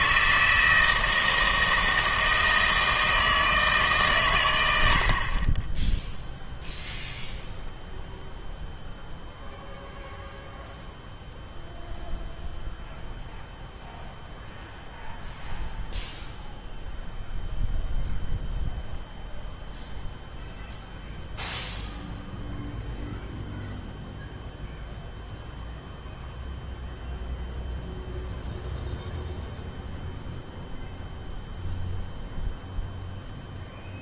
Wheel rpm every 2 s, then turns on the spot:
160, 160, 100, 0, 0, 0, 0, 0, 0, 0, 0, 0, 0, 0, 0, 0, 0.
none